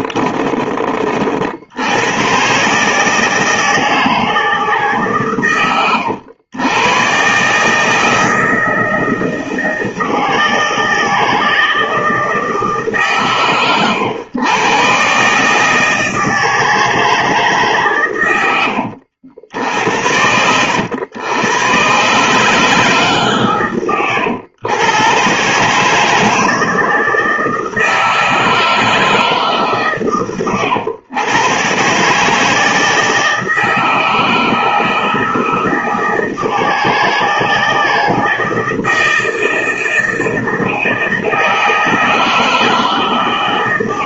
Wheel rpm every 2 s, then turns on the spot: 40, 150, 140, 120, 160, 160, 150, 140, 160, 70, 90, 140, 120, 160, 160, 110, 160, 160, 160, 160, 160, 140.
none